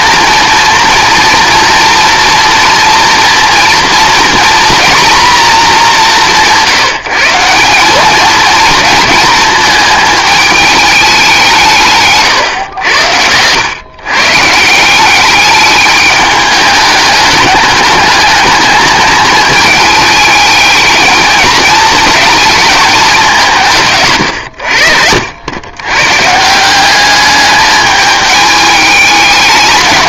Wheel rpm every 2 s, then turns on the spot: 240, 230, 240, 170, 220, 210, 100, 160, 210, 210, 210, 220, 80, 180, 210.
24-26